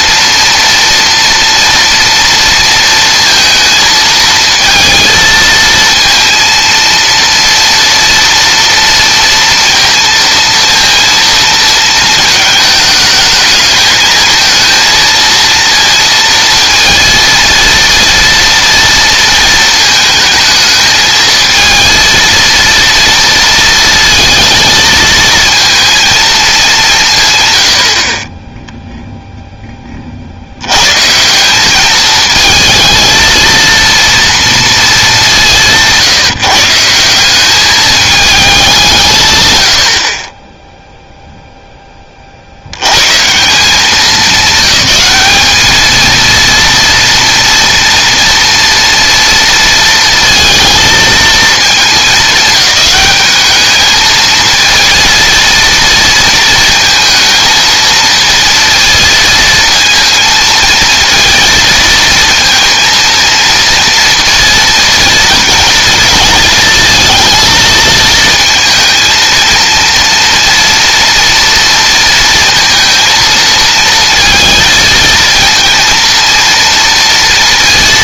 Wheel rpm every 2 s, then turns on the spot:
230, 230, 230, 230, 230, 230, 220, 230, 230, 230, 220, 230, 220, 210, 10, 90, 220, 230, 170, 200, 10, 80, 200, 230, 230, 230, 210, 220, 230, 230, 220, 220, 230, 220, 230, 230, 230, 220, 230.
none